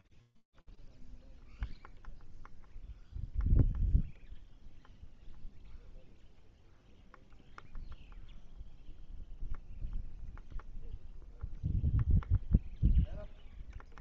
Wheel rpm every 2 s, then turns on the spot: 0, 0, 0, 0, 0, 0, 0.
none